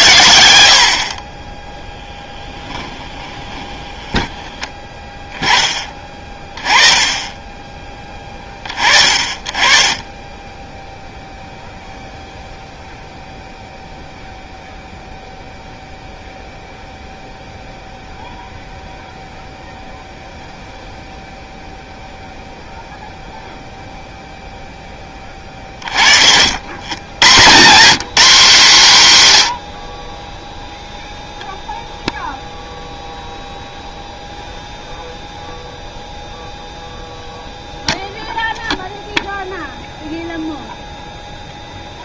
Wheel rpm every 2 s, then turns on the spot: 70, 10, 10, 20, 20, 10, 0, 0, 0, 0, 0, 0, 0, 80, 200, 0, 0, 0, 0, 0, 0.
2-4